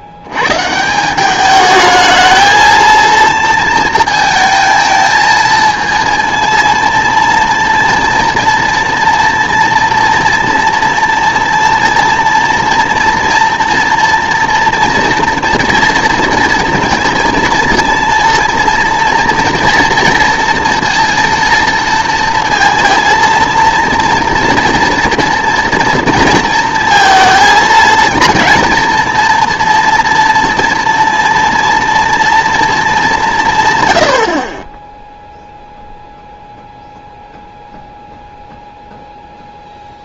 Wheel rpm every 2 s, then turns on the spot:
130, 220, 220, 230, 230, 240, 230, 230, 230, 230, 230, 230, 230, 230, 230, 230, 230, 30, 0, 0.
none